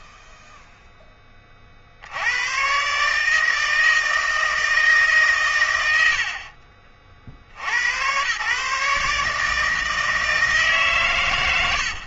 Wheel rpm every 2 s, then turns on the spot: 0, 130, 160, 50, 130, 160.
none